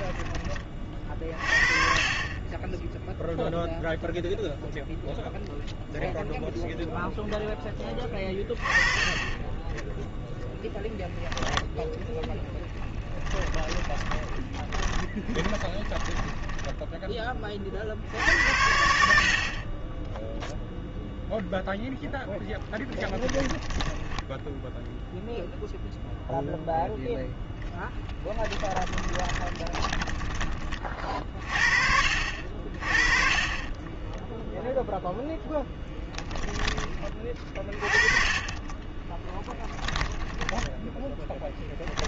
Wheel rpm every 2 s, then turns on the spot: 30, 10, 0, 0, 20, 10, 20, 20, 10, 70, 0, 20, 0, 0, 10, 30, 40, 0, 20, 10, 10.
12-18 22-24 40-42